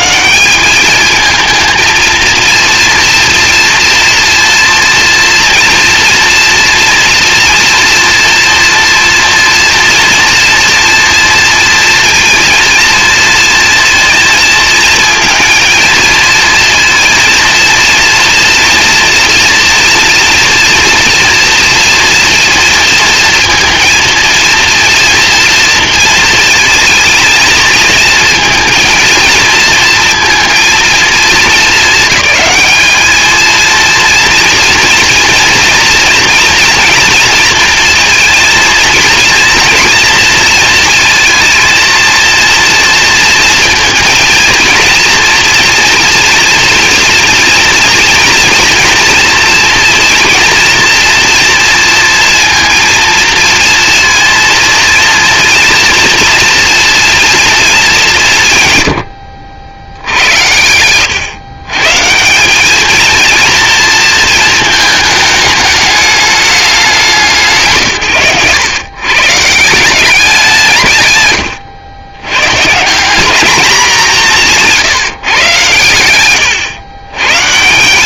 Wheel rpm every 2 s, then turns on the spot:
220, 230, 230, 230, 230, 230, 230, 230, 230, 230, 230, 230, 230, 220, 230, 230, 220, 230, 230, 230, 230, 230, 230, 230, 230, 230, 230, 230, 230, 120, 110, 220, 220, 190, 130, 140, 170, 170, 120.
none